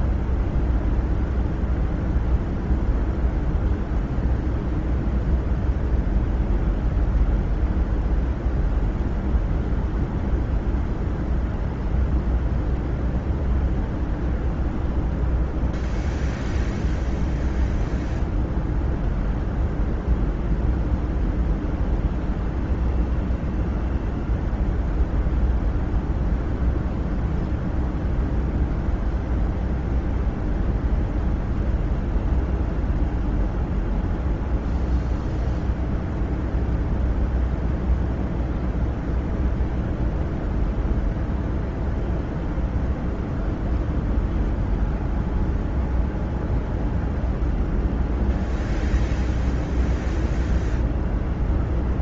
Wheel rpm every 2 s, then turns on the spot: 0, 0, 0, 0, 0, 0, 0, 0, 0, 0, 0, 0, 0, 0, 0, 0, 0, 0, 0, 0, 0, 0, 0, 0, 0, 0.
none